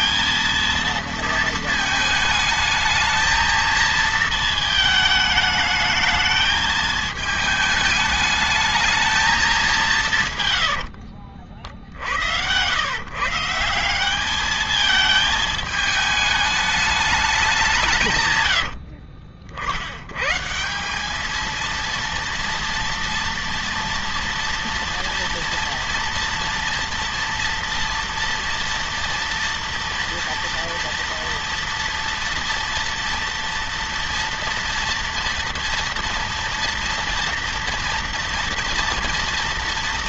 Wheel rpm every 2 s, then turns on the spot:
230, 220, 220, 220, 220, 70, 120, 220, 200, 60, 190, 230, 230, 230, 230, 240, 230, 230, 230, 230.
10-12 18-20